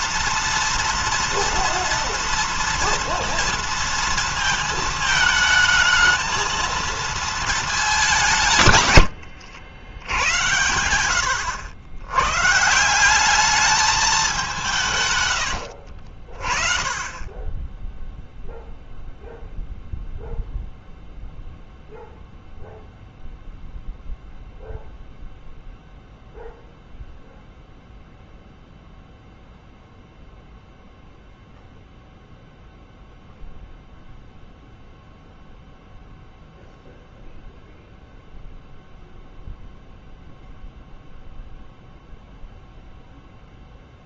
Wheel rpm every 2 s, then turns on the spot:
230, 230, 220, 230, 140, 90, 150, 160, 40, 0, 0, 0, 0, 0, 0, 0, 0, 0, 0, 0, 0, 0.
none